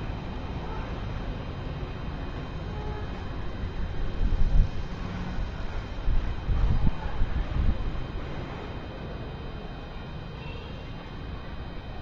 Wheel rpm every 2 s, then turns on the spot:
0, 0, 0, 0, 0, 0.
none